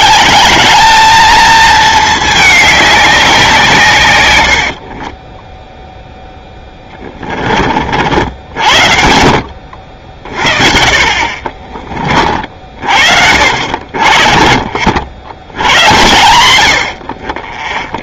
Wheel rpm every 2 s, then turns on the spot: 210, 210, 70, 10, 70, 50, 60, 60, 110.
4-8